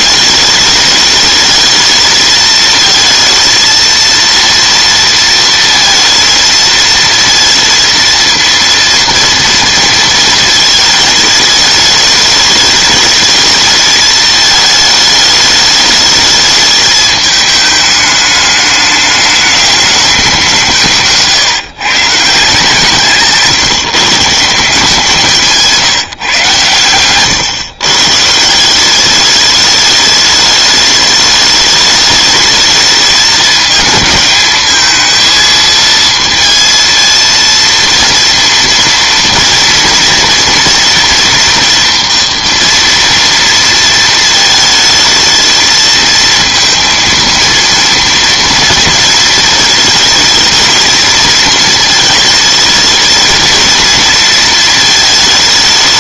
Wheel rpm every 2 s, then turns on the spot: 210, 220, 230, 220, 230, 220, 210, 220, 210, 210, 170, 150, 170, 120, 180, 210, 220, 220, 230, 230, 230, 240, 220, 230, 230, 220, 220, 220.
none